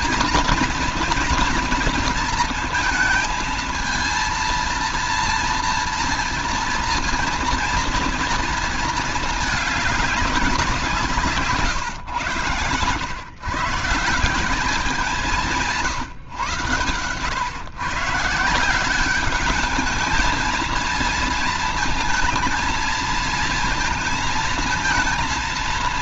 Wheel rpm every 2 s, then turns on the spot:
230, 230, 230, 230, 230, 190, 120, 180, 130, 160, 220, 220, 230.
none